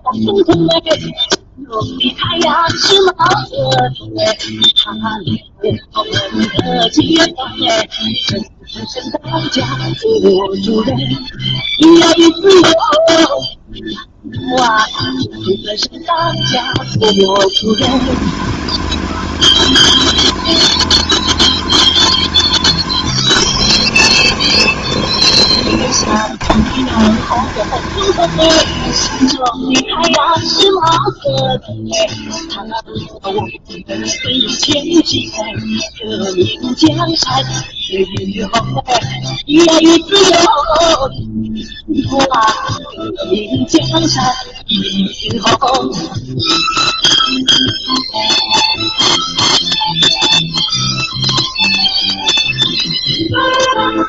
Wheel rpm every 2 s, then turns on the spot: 0, 0, 0, 0, 0, 0, 0, 0, 40, 220, 220, 190, 210, 210, 110, 0, 0, 0, 0, 0, 0, 0, 0, 0, 0, 0, 0.
none